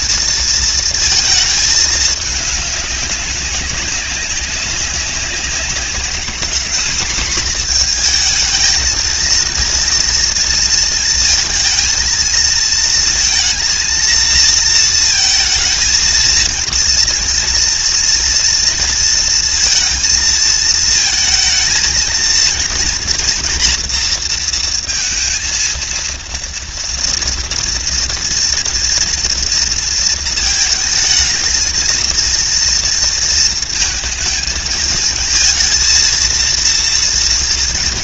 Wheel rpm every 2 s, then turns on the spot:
230, 200, 190, 230, 220, 230, 220, 230, 230, 230, 220, 230, 230, 230, 230, 220, 230, 220, 240.
none